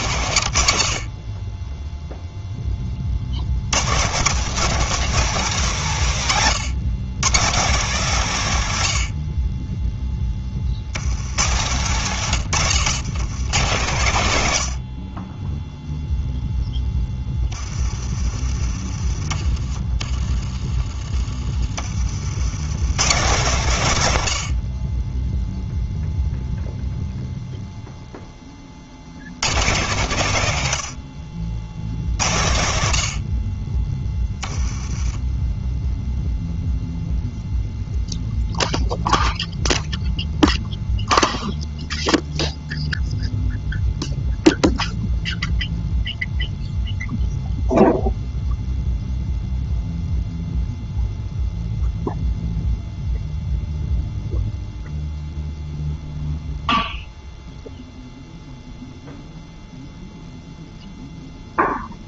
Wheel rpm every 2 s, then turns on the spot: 60, 20, 210, 130, 90, 40, 130, 60, 10, 30, 30, 120, 30, 0, 50, 90, 80, 10, 0, 0, 0, 0, 0, 0, 0, 0, 0, 0, 0, 0, 0.
12-14